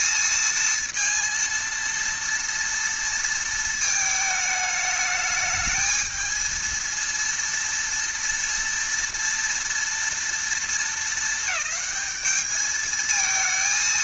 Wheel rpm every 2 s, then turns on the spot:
230, 230, 210, 220, 230, 230, 220.
none